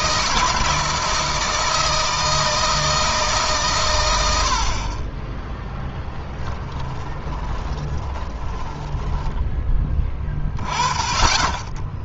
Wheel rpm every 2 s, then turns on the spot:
160, 160, 40, 10, 10, 20.
6-10